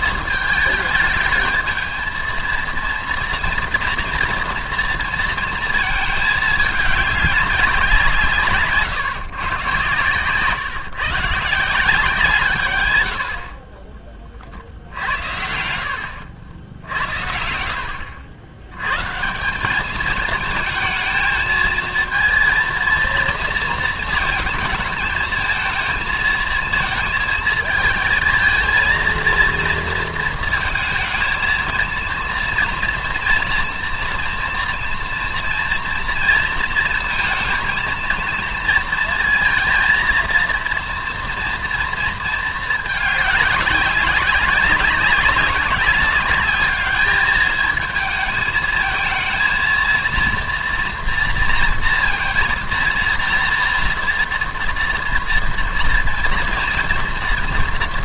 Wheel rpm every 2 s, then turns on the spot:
220, 230, 230, 210, 160, 150, 130, 60, 80, 100, 220, 230, 230, 230, 230, 220, 230, 230, 230, 230, 230, 210, 200, 210, 220, 230, 230, 230, 240.
none